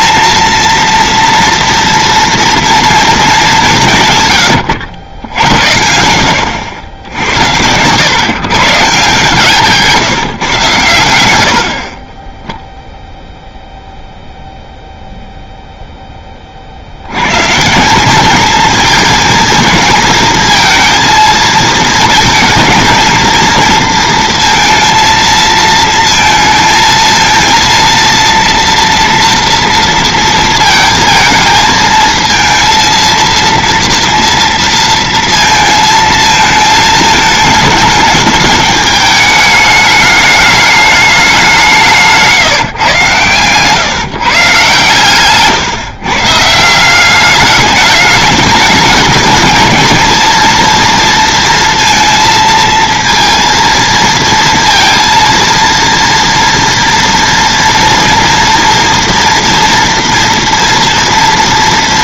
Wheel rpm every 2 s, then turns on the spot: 230, 230, 100, 80, 140, 130, 0, 0, 60, 220, 230, 230, 230, 230, 230, 230, 230, 230, 220, 210, 210, 140, 140, 170, 210, 230, 230, 230, 230, 230, 230.
4-6